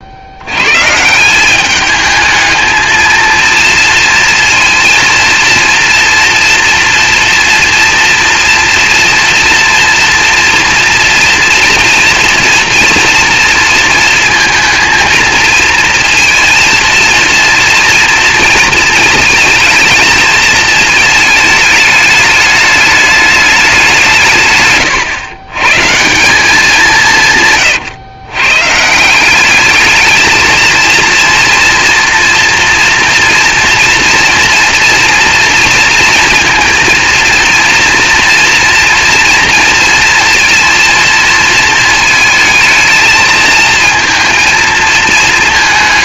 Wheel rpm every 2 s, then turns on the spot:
150, 230, 230, 230, 230, 240, 240, 230, 230, 230, 220, 210, 140, 180, 190, 220, 230, 230, 230, 230, 230, 220, 220.
24-26